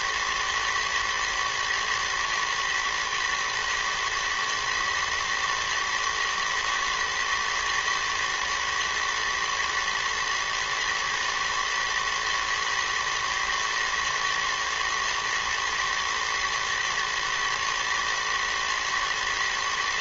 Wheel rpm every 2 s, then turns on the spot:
110, 110, 120, 110, 110, 110, 120, 120, 110, 110.
none